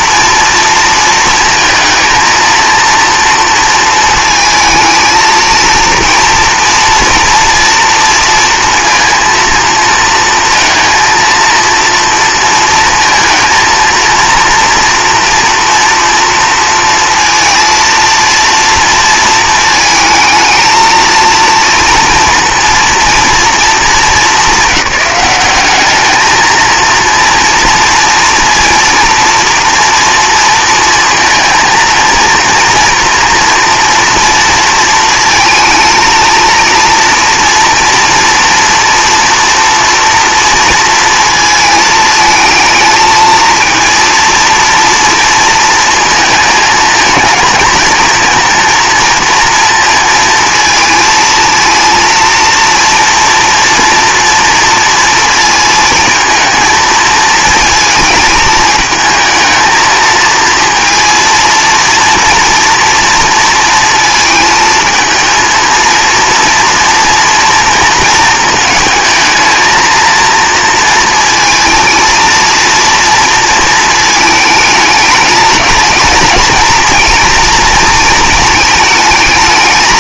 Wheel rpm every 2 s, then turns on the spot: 230, 230, 220, 230, 230, 230, 230, 240, 230, 230, 230, 230, 200, 230, 230, 230, 230, 230, 230, 230, 230, 220, 230, 220, 230, 230, 230, 230, 220, 220, 230, 230, 220, 230, 220, 220, 230, 210, 230, 220.
none